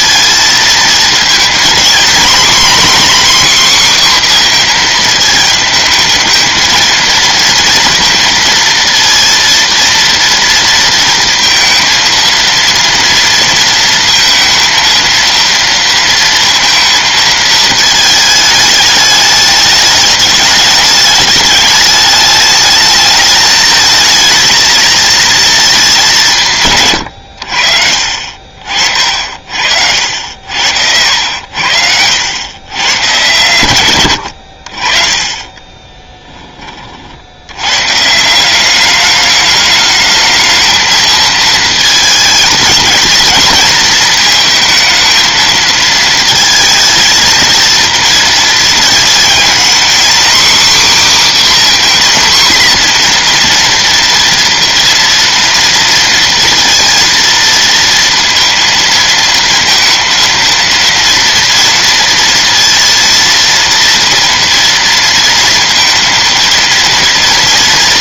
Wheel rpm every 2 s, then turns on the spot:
220, 240, 240, 220, 230, 230, 230, 230, 230, 220, 210, 210, 220, 150, 50, 70, 110, 70, 20, 180, 220, 220, 230, 230, 230, 270, 250, 230, 230, 230, 230, 230, 230, 230.
none